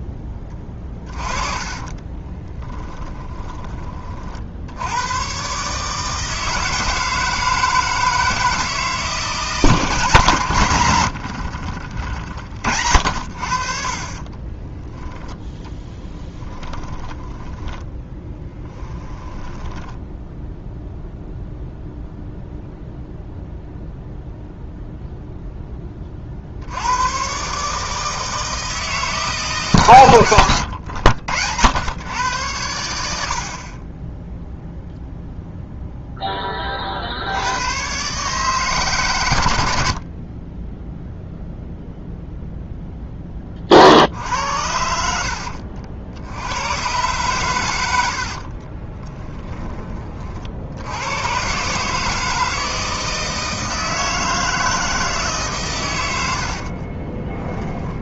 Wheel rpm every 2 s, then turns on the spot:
20, 10, 80, 160, 160, 120, 70, 10, 10, 10, 0, 0, 0, 90, 160, 100, 90, 0, 30, 140, 10, 0, 70, 110, 30, 80, 160, 160, 60.
0-4 14-20 48-50 56-58